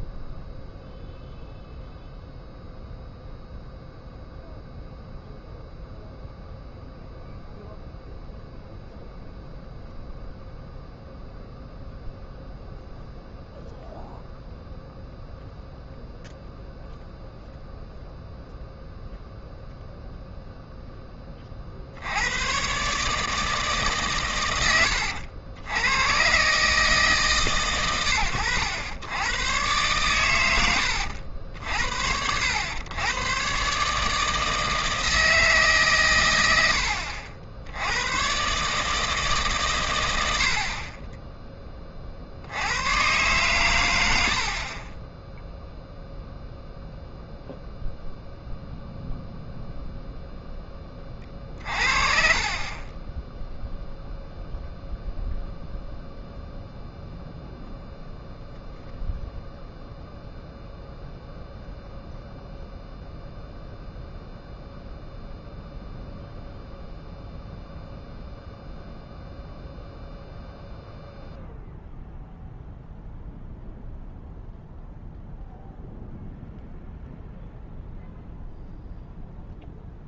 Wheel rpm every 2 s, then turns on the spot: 0, 0, 0, 0, 0, 0, 0, 0, 0, 0, 0, 130, 90, 140, 100, 80, 100, 160, 90, 140, 60, 100, 30, 0, 0, 10, 30, 0, 0, 0, 0, 0, 0, 0, 0, 0, 0, 0, 0, 0.
none